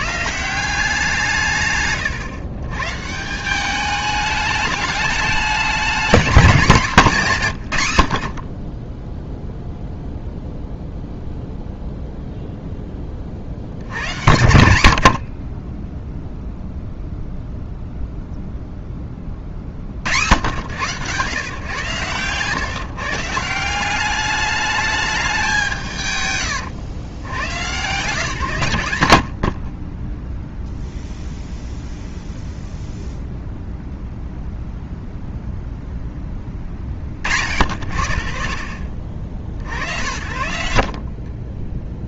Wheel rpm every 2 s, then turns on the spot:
170, 130, 210, 210, 40, 0, 0, 100, 0, 0, 110, 130, 210, 110, 140, 0, 0, 0, 20, 50, 70.
none